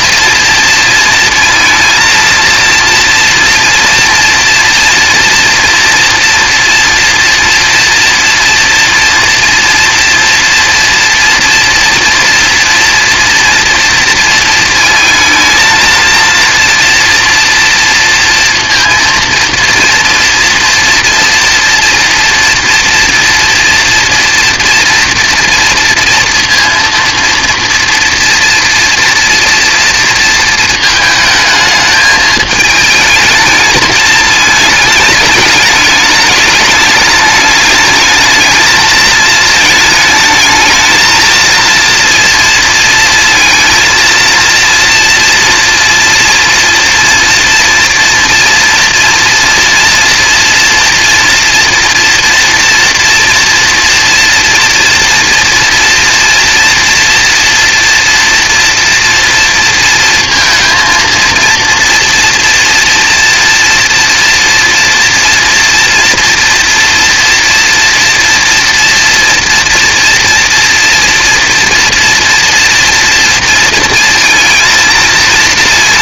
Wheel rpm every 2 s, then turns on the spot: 230, 230, 230, 230, 230, 230, 230, 230, 230, 230, 230, 230, 230, 230, 230, 220, 220, 210, 210, 220, 220, 240, 230, 240, 230, 230, 230, 230, 240, 230, 230, 230, 240, 240, 230, 240, 230, 230.
none